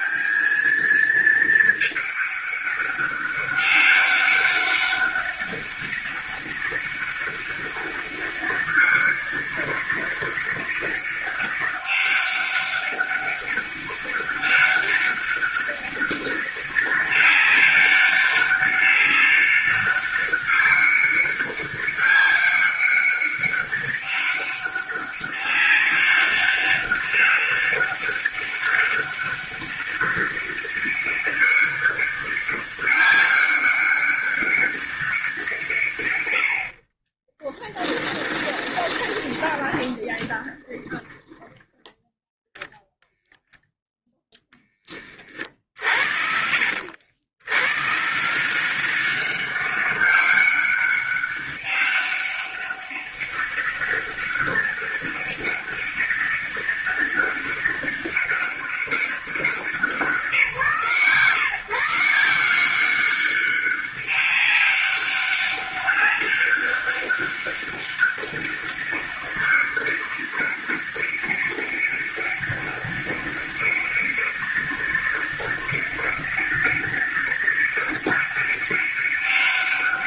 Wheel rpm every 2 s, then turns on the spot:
220, 200, 200, 200, 200, 200, 200, 200, 200, 200, 200, 190, 200, 200, 200, 200, 200, 200, 50, 20, 10, 0, 10, 80, 180, 200, 200, 200, 200, 200, 160, 180, 200, 200, 200, 200, 200, 200, 200, 200.
36-42